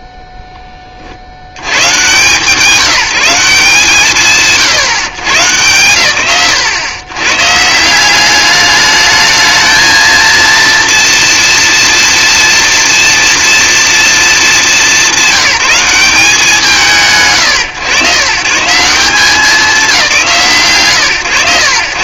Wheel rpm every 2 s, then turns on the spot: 20, 180, 120, 100, 210, 230, 230, 210, 160, 150, 150.
none